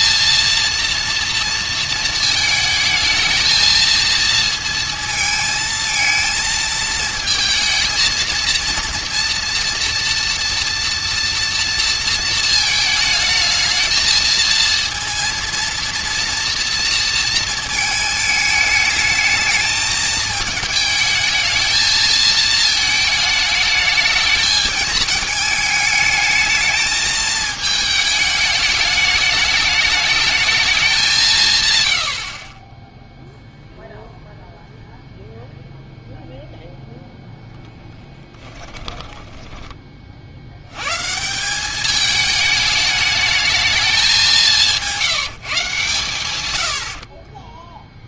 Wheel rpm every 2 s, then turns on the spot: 230, 220, 230, 220, 230, 240, 220, 230, 230, 220, 220, 220, 220, 220, 210, 210, 30, 0, 0, 10, 90, 210, 180, 100.
32-34 38-40